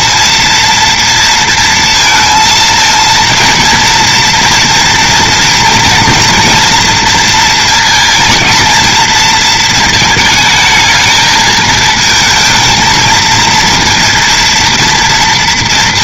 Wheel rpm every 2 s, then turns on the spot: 240, 220, 230, 240, 230, 220, 220, 230.
none